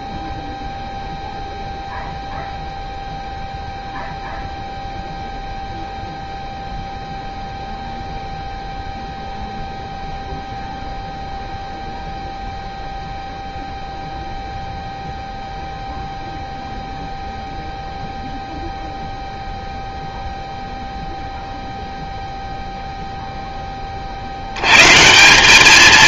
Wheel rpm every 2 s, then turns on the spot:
0, 0, 0, 0, 0, 0, 0, 0, 0, 0, 0, 0, 20.
none